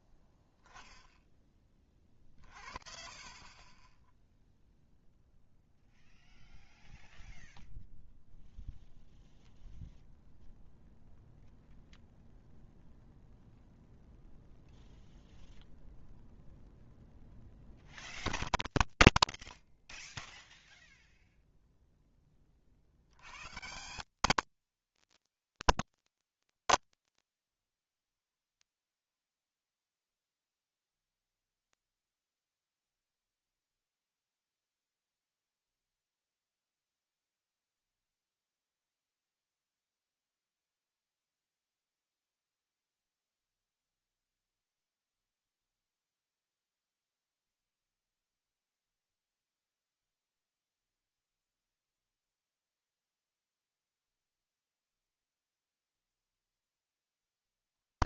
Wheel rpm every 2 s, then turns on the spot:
10, 40, 0, 0, 0, 0, 0, 0, 0, 0, 0, 30, 180, 20, 50, 0, 0, 0, 0, 0, 0, 0, 0, 0, 0, 0, 0, 0, 0.
26-28